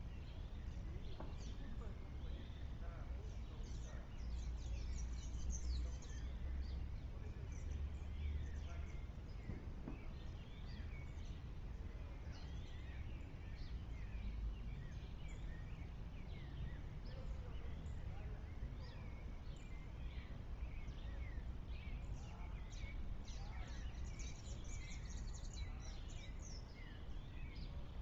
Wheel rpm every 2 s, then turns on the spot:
0, 0, 0, 0, 0, 0, 0, 0, 0, 0, 0, 0, 0, 0.
none